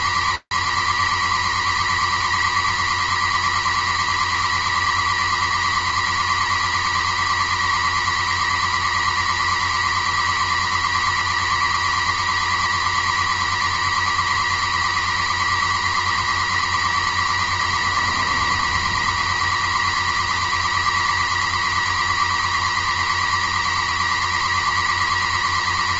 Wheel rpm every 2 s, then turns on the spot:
140, 130, 130, 130, 130, 130, 130, 130, 130, 130, 130, 130, 130.
none